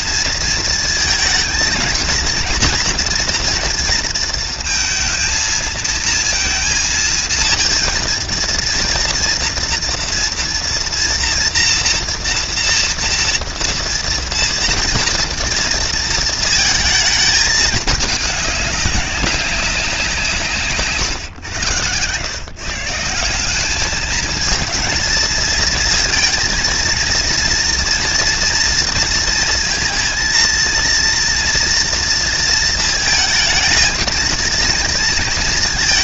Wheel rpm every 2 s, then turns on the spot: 220, 240, 220, 230, 240, 240, 230, 230, 220, 200, 130, 160, 220, 230, 230, 230, 220, 220.
none